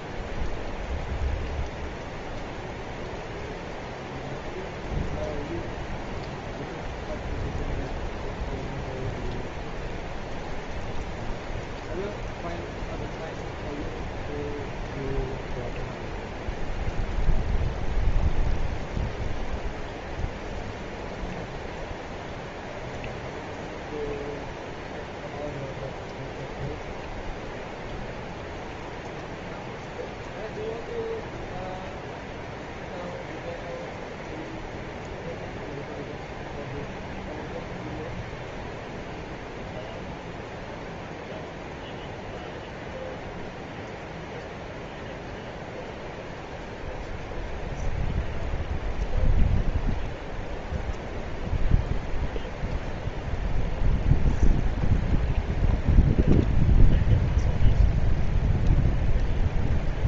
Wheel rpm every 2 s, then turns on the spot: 0, 0, 0, 0, 0, 0, 0, 0, 0, 0, 0, 0, 0, 0, 0, 0, 0, 0, 0, 0, 0, 0, 0, 0, 0, 0, 0, 0, 0, 0.
none